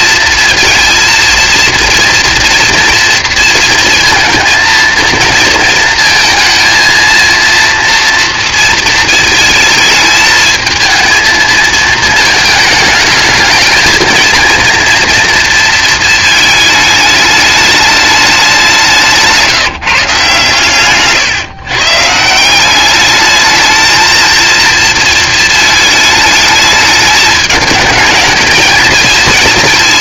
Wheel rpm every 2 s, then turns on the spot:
230, 230, 230, 230, 230, 220, 210, 230, 220, 200, 140, 180, 230, 220, 220.
none